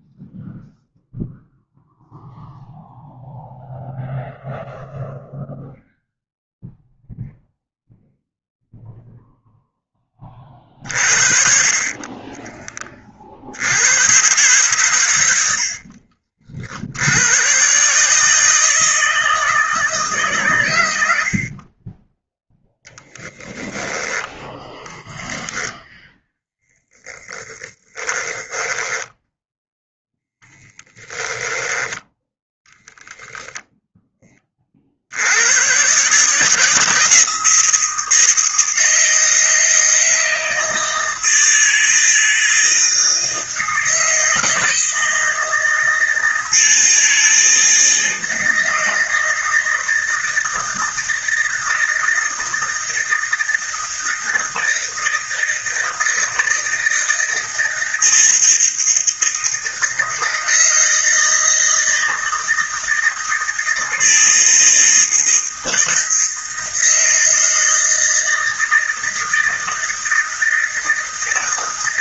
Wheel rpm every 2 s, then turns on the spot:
0, 0, 0, 0, 0, 40, 30, 120, 70, 160, 100, 0, 0, 0, 10, 10, 0, 50, 160, 160, 160, 160, 160, 160, 160, 160, 160, 160, 160, 160, 160, 160, 160, 160, 160, 160.
28-32